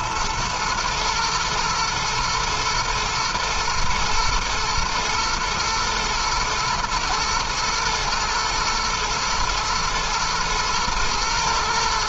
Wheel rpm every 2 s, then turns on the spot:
110, 110, 120, 110, 110, 110.
none